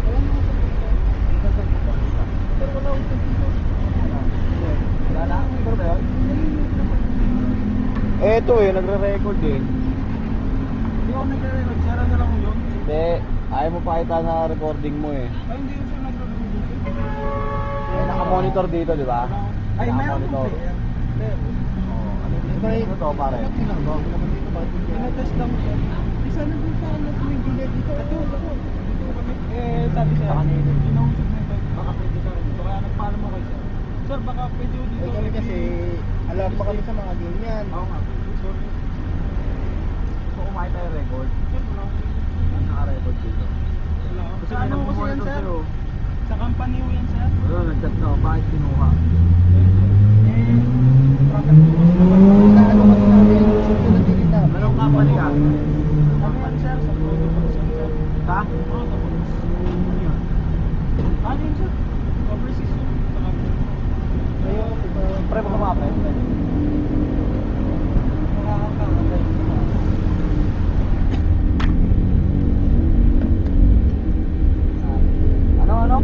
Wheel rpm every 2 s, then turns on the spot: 0, 0, 0, 0, 0, 0, 0, 0, 0, 0, 0, 0, 0, 0, 0, 0, 0, 0, 0, 0, 0, 0, 0, 0, 0, 0, 0, 0, 0, 0, 0, 0, 0, 0, 0, 0, 0, 0.
none